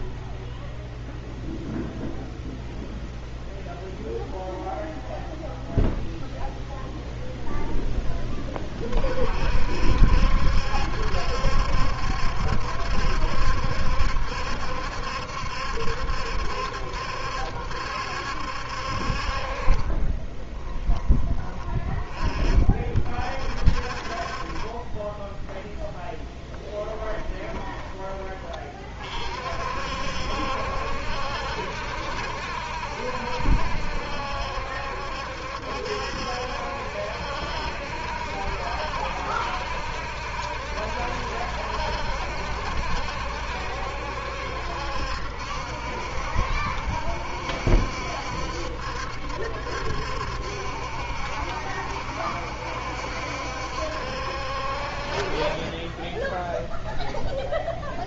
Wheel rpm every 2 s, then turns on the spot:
0, 0, 0, 0, 40, 70, 70, 70, 70, 60, 20, 40, 20, 10, 30, 70, 70, 70, 60, 60, 70, 70, 70, 70, 70, 70, 70, 50, 0.
20-22 26-28